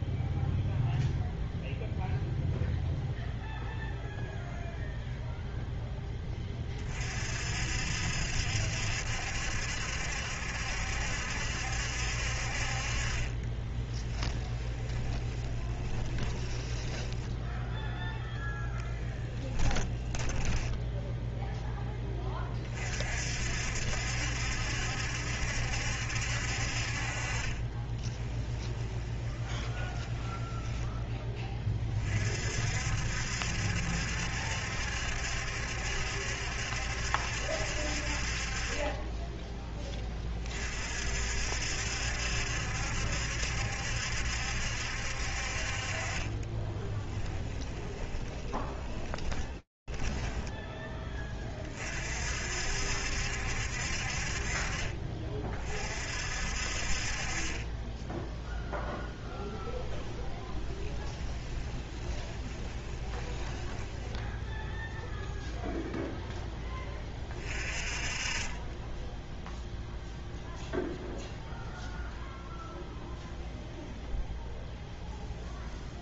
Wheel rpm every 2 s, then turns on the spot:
0, 0, 0, 30, 70, 70, 40, 10, 10, 10, 10, 30, 70, 50, 10, 10, 60, 70, 70, 30, 40, 70, 70, 20, 10, 20, 60, 40, 50, 0, 10, 30, 0, 20, 10, 0, 0, 0.
12-22 28-32 46-50 60-64